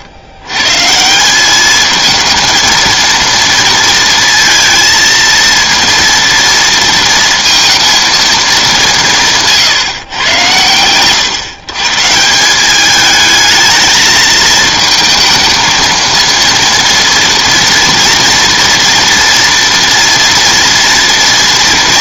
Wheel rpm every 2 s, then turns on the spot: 130, 230, 230, 230, 190, 110, 200, 220, 230, 240, 230.
none